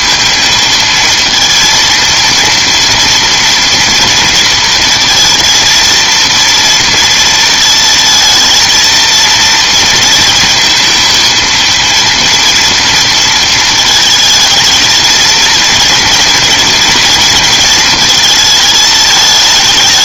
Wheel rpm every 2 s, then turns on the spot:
220, 230, 230, 230, 220, 230, 230, 220, 230, 220.
none